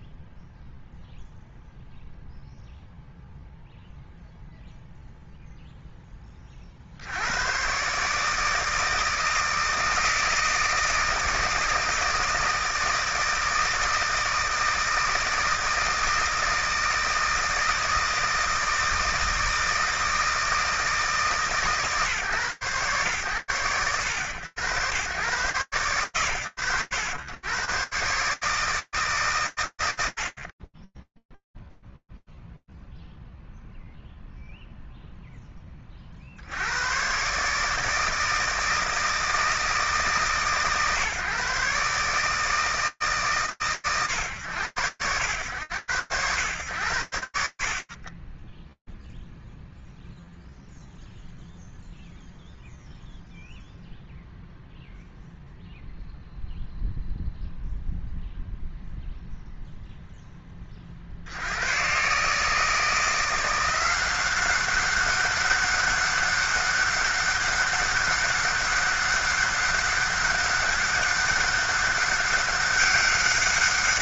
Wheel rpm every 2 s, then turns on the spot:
0, 0, 0, 110, 160, 160, 160, 160, 160, 160, 150, 110, 120, 80, 140, 20, 0, 0, 100, 160, 130, 150, 100, 80, 0, 0, 0, 0, 0, 0, 100, 170, 190, 200, 200, 190, 200.
none